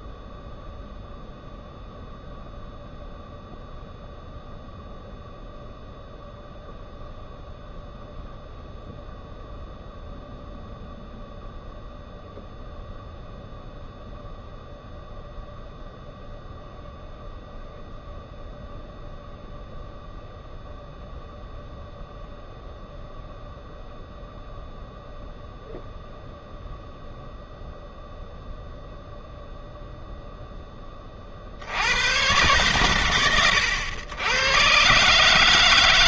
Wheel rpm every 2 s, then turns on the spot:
0, 0, 0, 0, 0, 0, 0, 0, 0, 0, 0, 0, 0, 0, 0, 10, 120, 120.
none